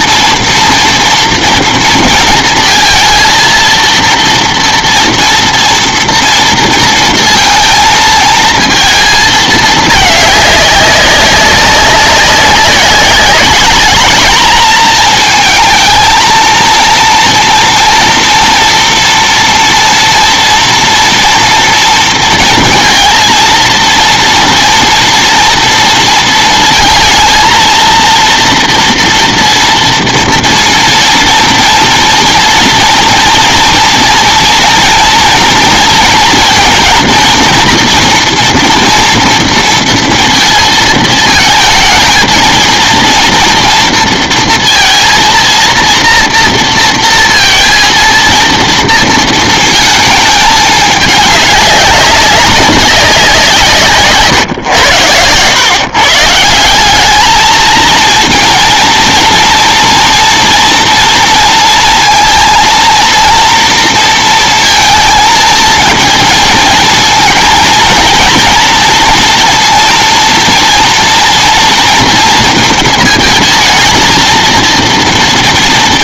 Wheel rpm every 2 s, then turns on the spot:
240, 220, 230, 230, 220, 200, 200, 220, 230, 230, 240, 230, 230, 230, 230, 230, 230, 230, 230, 240, 230, 230, 230, 240, 230, 210, 200, 120, 170, 230, 230, 230, 230, 230, 230, 230, 230, 230.
none